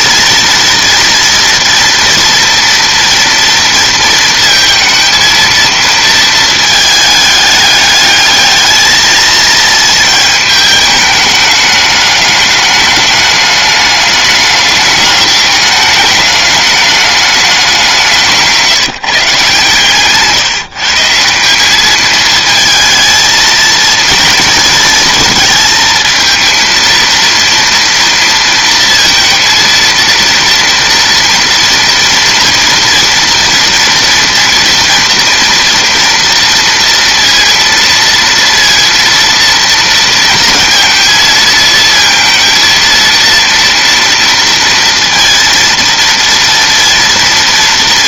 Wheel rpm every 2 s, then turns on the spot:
230, 240, 230, 220, 220, 210, 210, 200, 200, 150, 160, 220, 230, 230, 230, 230, 230, 230, 230, 230, 230, 230, 230, 230.
none